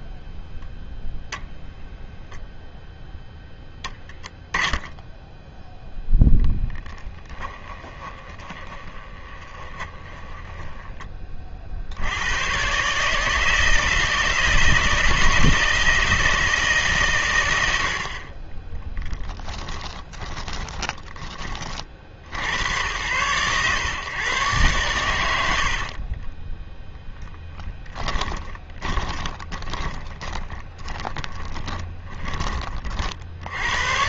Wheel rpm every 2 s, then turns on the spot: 0, 0, 0, 20, 20, 10, 130, 160, 150, 10, 30, 90, 110, 10, 20, 30, 30.
6-10 20-22 26-32